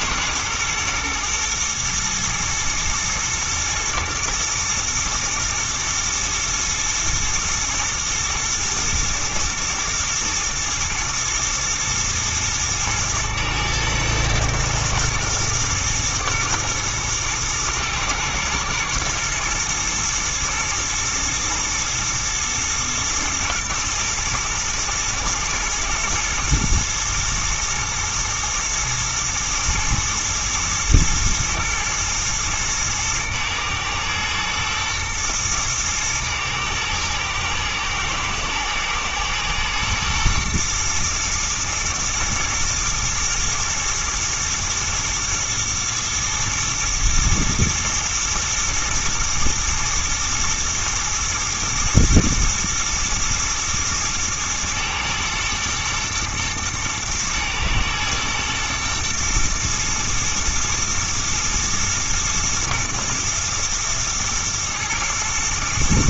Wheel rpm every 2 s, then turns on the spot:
120, 110, 120, 120, 110, 120, 110, 120, 120, 120, 110, 110, 110, 110, 120, 110, 110, 110, 110, 110, 120, 110, 120, 110, 120, 110, 120, 110, 120, 110, 110, 120, 110.
none